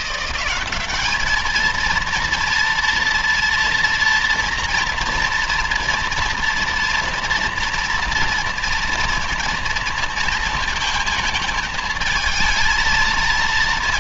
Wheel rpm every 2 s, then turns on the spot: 200, 230, 230, 230, 230, 230, 230.
none